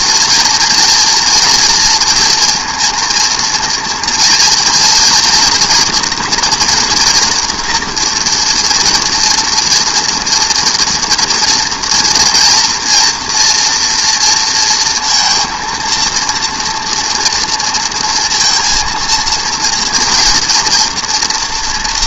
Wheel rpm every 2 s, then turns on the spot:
230, 230, 240, 240, 240, 230, 230, 230, 230, 230, 230.
none